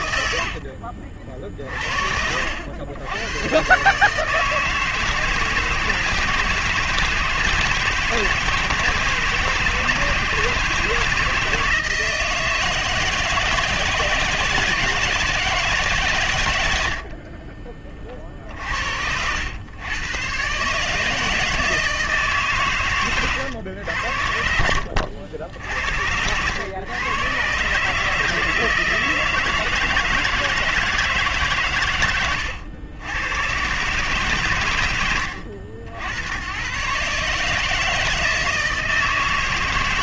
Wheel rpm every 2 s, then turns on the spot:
70, 120, 160, 170, 160, 160, 160, 160, 90, 60, 130, 140, 80, 110, 160, 160, 110, 80, 120, 160.
0-2 18-20